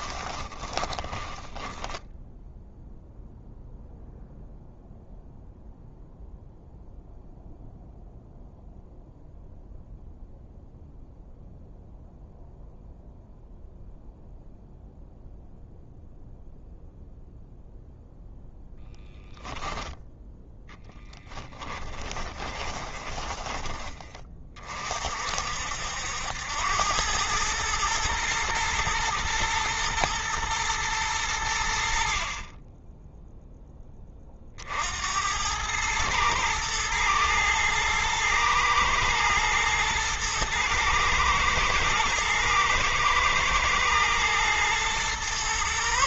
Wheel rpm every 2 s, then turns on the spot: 10, 0, 0, 0, 0, 0, 0, 0, 0, 0, 10, 20, 40, 100, 120, 100, 10, 70, 110, 110, 110, 120, 120.
0-2 20-24